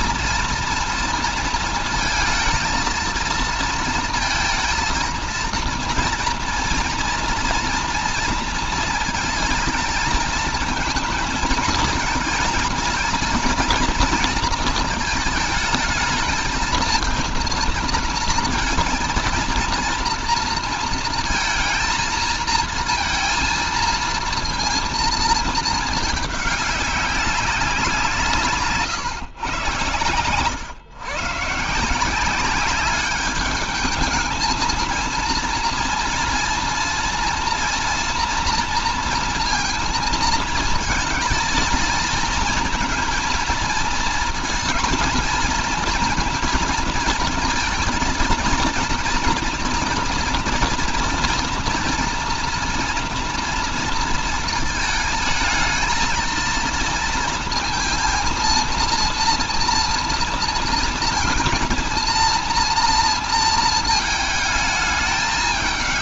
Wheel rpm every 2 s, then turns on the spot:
230, 220, 230, 230, 230, 220, 220, 230, 220, 230, 230, 230, 230, 210, 160, 110, 190, 220, 230, 230, 230, 230, 230, 230, 230, 240, 230, 230, 230, 230, 230, 230, 220.
none